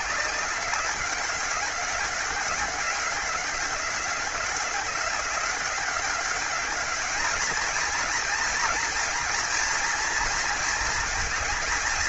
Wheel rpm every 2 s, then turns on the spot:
190, 190, 190, 210, 230, 230.
none